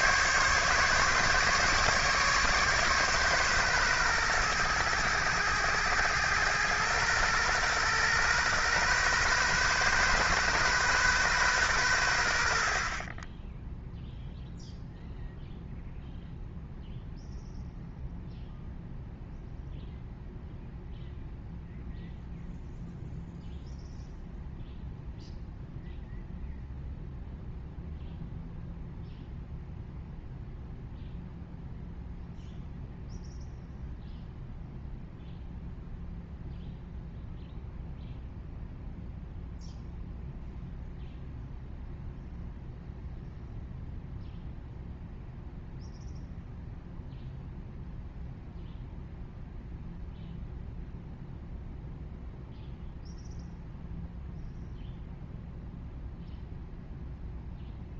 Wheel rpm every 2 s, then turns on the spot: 140, 140, 110, 110, 130, 130, 50, 0, 0, 0, 0, 0, 0, 0, 0, 0, 0, 0, 0, 0, 0, 0, 0, 0, 0, 0, 0, 0, 0.
none